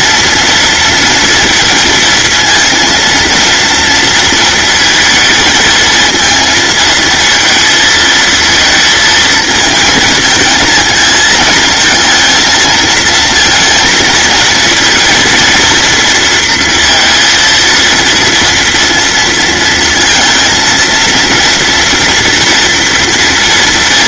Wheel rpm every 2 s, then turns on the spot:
230, 230, 230, 220, 230, 220, 230, 230, 230, 230, 230, 230.
none